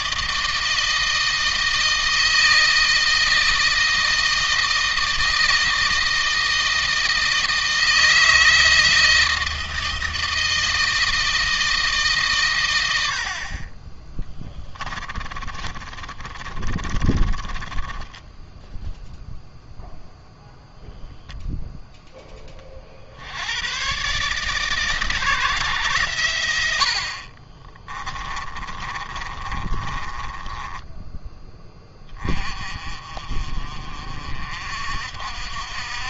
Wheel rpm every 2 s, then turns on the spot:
160, 160, 160, 160, 160, 160, 80, 20, 30, 0, 0, 50, 150, 60, 20, 10, 30, 60.
14-18 28-30